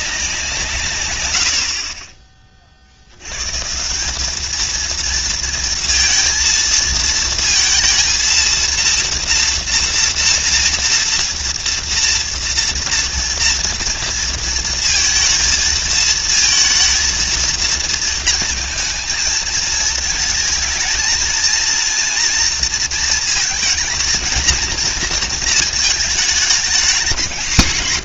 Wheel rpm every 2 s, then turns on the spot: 100, 90, 230, 230, 230, 230, 240, 230, 220, 220, 230, 230, 230, 190.
none